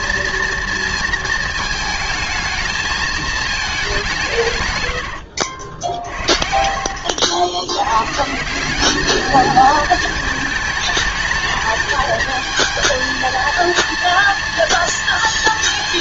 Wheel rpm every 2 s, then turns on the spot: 220, 120, 60, 190, 220, 220, 230, 230.
2-6